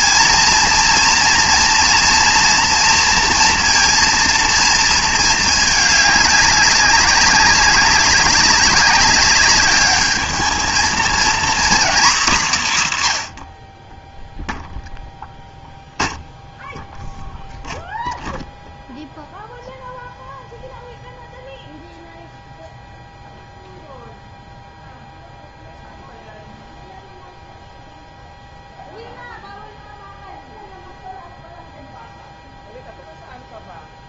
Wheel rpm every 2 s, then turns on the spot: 230, 230, 230, 200, 200, 220, 170, 0, 0, 0, 0, 0, 0, 0, 0, 0, 0.
none